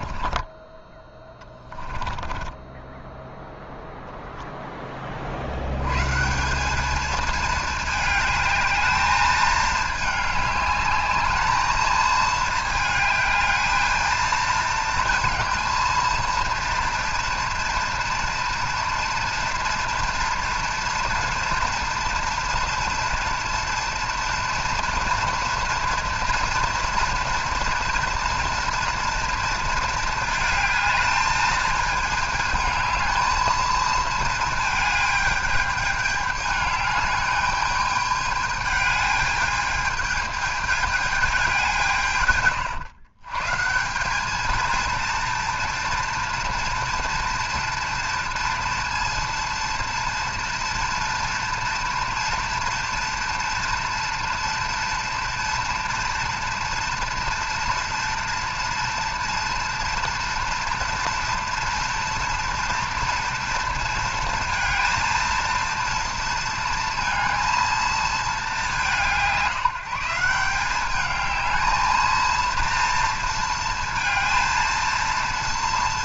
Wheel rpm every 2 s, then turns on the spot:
20, 10, 20, 210, 210, 210, 220, 230, 230, 230, 230, 230, 230, 230, 230, 220, 220, 220, 210, 210, 210, 120, 230, 230, 230, 230, 230, 230, 230, 230, 230, 230, 230, 230, 170, 200, 230, 230.
2-4